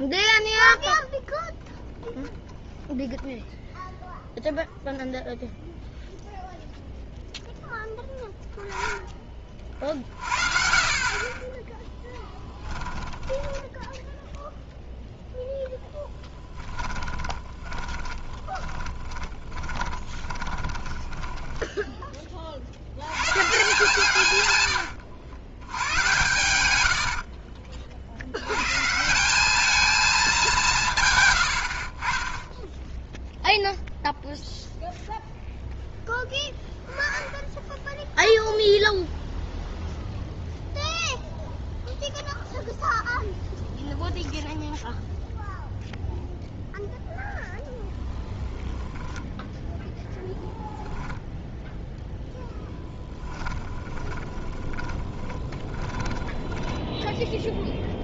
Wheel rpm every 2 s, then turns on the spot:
0, 0, 0, 0, 20, 30, 10, 0, 10, 20, 10, 80, 100, 80, 150, 150, 0, 0, 0, 0, 0, 0, 0, 0, 20, 0, 0, 20, 10.
12-14 16-22 26-28 48-50 54-58